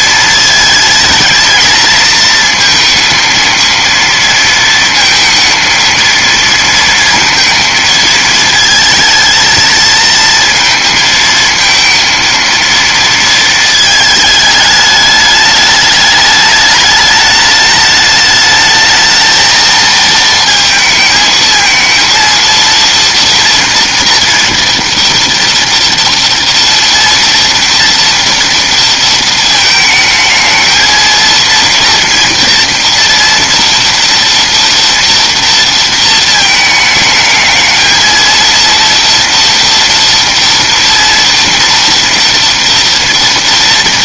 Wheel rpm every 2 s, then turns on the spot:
220, 220, 230, 230, 220, 220, 230, 210, 210, 220, 230, 230, 230, 230, 230, 220, 240, 230, 220, 230, 230, 230.
none